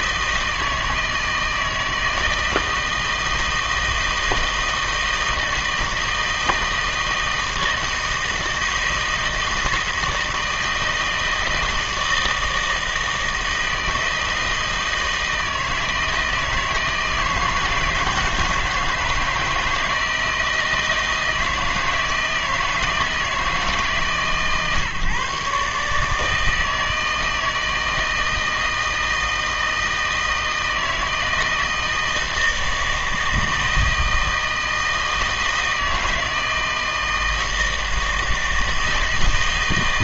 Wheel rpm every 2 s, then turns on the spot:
160, 160, 160, 160, 160, 160, 160, 160, 160, 160, 160, 160, 140, 160, 160, 160, 160, 160, 160, 160.
none